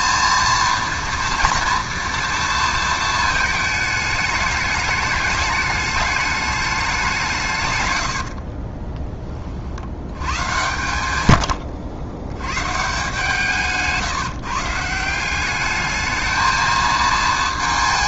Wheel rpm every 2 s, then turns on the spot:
230, 230, 210, 210, 50, 110, 120, 150, 220.
8-12